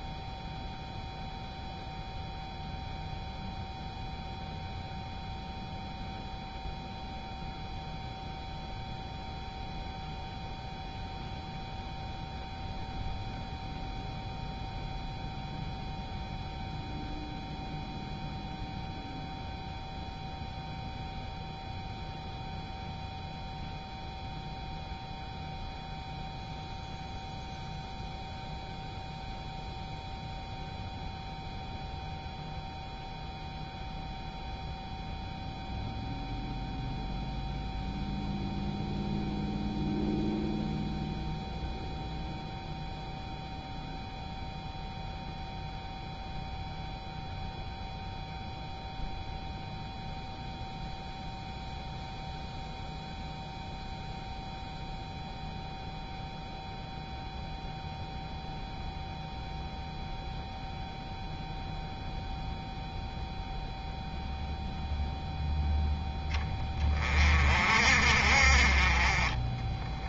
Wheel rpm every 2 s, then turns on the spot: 0, 0, 0, 0, 0, 0, 0, 0, 0, 0, 0, 0, 0, 0, 0, 0, 0, 0, 0, 0, 0, 0, 0, 0, 0, 0, 0, 0, 0, 0, 0, 0, 0, 30, 30.
none